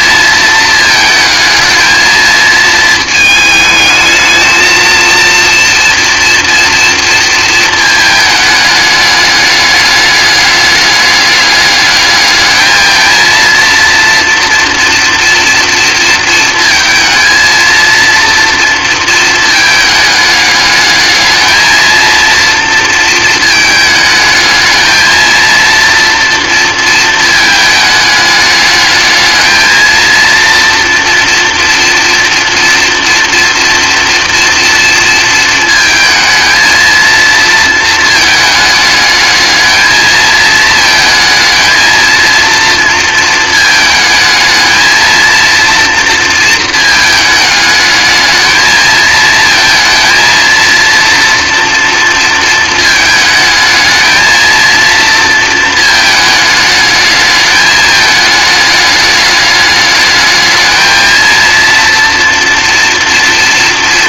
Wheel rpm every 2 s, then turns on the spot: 220, 220, 220, 230, 220, 210, 220, 240, 230, 230, 210, 230, 220, 230, 210, 230, 230, 230, 230, 220, 230, 230, 220, 230, 220, 230, 230, 220, 220, 210, 220, 240.
none